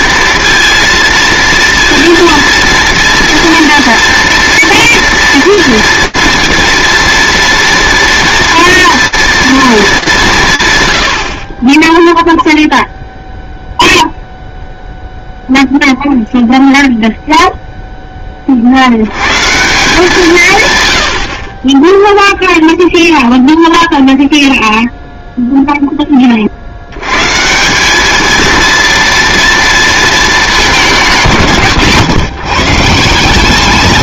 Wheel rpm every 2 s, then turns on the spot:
230, 230, 240, 230, 230, 90, 0, 0, 0, 100, 90, 0, 0, 100, 230, 160, 160.
none